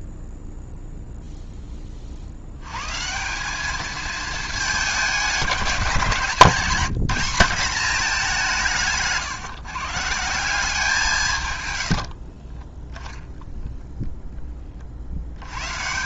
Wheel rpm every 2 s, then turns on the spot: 0, 130, 200, 180, 160, 170, 20, 60.
none